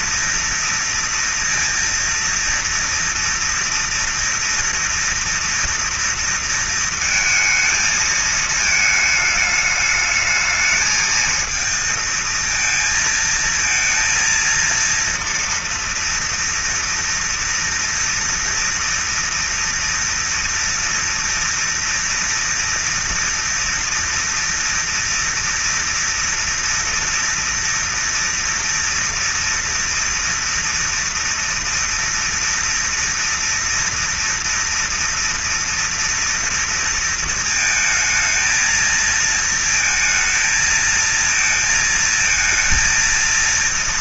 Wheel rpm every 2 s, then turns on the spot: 230, 230, 230, 230, 220, 220, 230, 230, 230, 230, 240, 230, 230, 230, 230, 230, 230, 240, 230, 220, 220, 220.
none